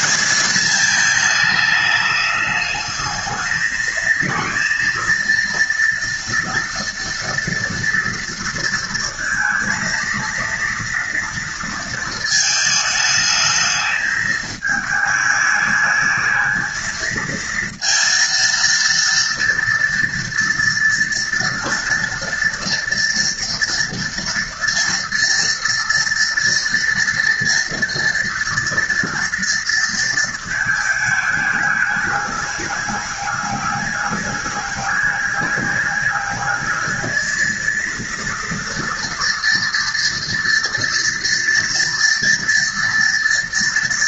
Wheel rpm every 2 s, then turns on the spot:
220, 210, 230, 230, 230, 230, 220, 210, 220, 230, 230, 230, 230, 230, 230, 220, 210, 210, 220, 230, 230, 230.
none